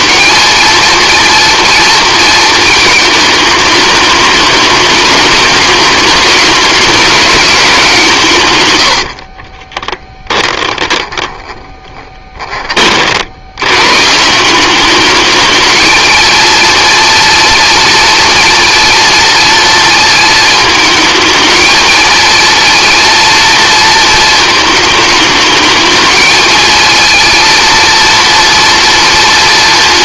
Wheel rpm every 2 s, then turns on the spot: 230, 220, 210, 210, 90, 10, 50, 200, 230, 230, 220, 230, 220, 220, 230.
8-12